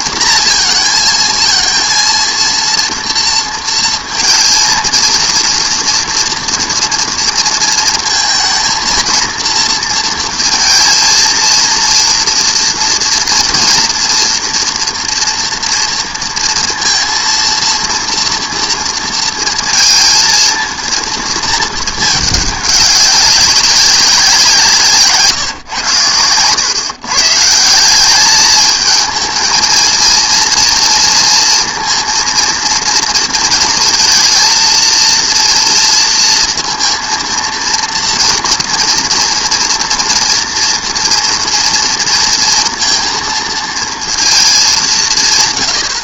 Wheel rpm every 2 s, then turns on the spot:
230, 230, 230, 230, 230, 230, 230, 230, 230, 230, 230, 210, 170, 120, 210, 230, 230, 230, 230, 230, 230, 230, 200.
none